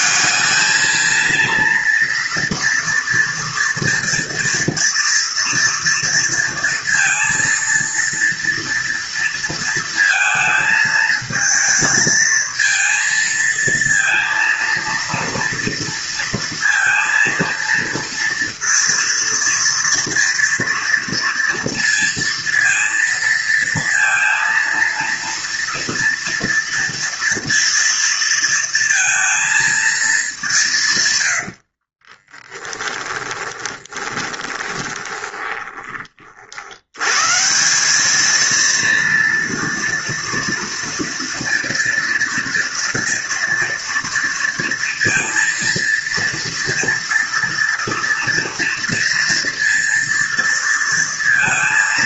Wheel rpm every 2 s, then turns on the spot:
220, 230, 230, 230, 230, 220, 220, 230, 230, 230, 230, 230, 230, 230, 230, 170, 20, 20, 90, 230, 230, 230, 230, 230, 230, 230.
32-36